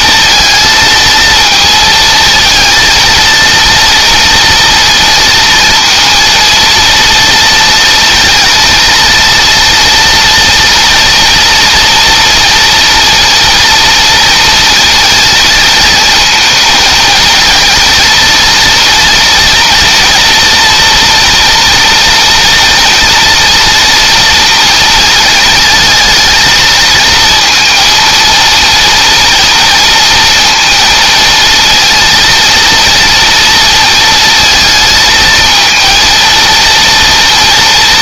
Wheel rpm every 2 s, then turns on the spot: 220, 230, 230, 230, 230, 230, 230, 230, 220, 230, 230, 230, 230, 230, 230, 230, 230, 220, 230.
none